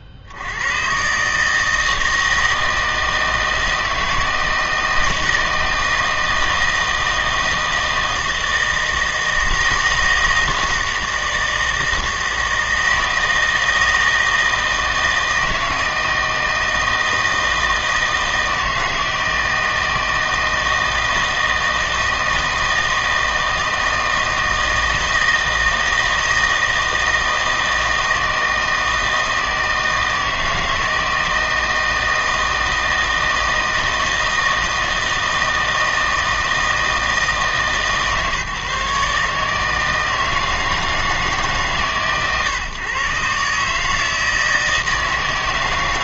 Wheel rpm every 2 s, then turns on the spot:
120, 160, 160, 160, 160, 160, 160, 160, 160, 160, 160, 160, 160, 160, 160, 160, 160, 160, 160, 150, 160, 130, 160.
none